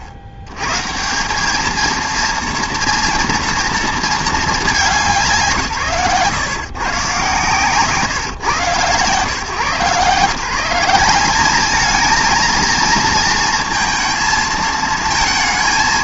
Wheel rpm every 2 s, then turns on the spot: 90, 230, 180, 150, 120, 170, 230, 230.
none